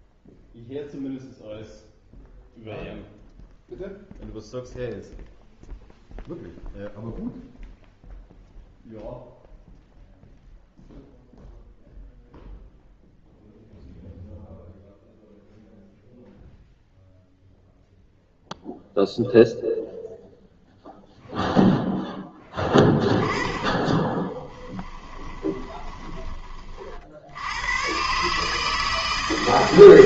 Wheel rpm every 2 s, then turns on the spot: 0, 0, 0, 0, 0, 0, 0, 0, 0, 0, 0, 10, 10, 40, 150.
22-26